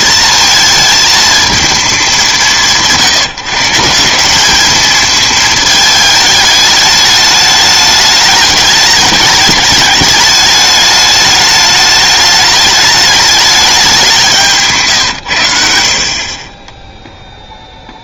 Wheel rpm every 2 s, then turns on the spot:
220, 170, 210, 210, 210, 210, 210, 160, 10.
16-18